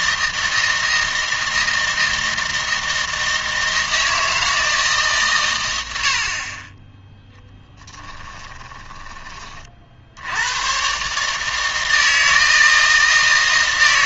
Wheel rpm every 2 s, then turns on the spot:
160, 160, 160, 30, 20, 120, 160.
8-10